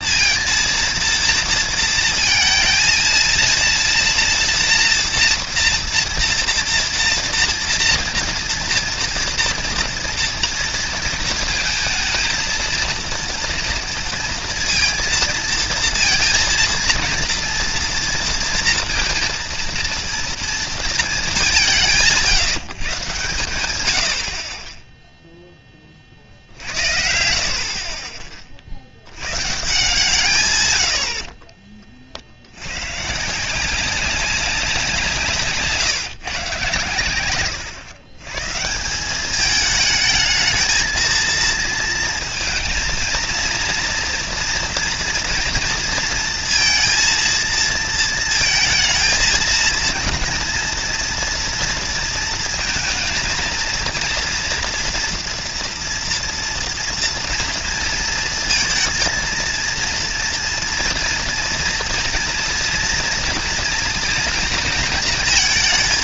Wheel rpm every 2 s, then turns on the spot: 230, 220, 230, 230, 230, 230, 230, 230, 230, 230, 230, 170, 40, 60, 50, 120, 80, 190, 130, 140, 220, 230, 230, 230, 230, 230, 230, 230, 240, 230, 230, 240, 230.
none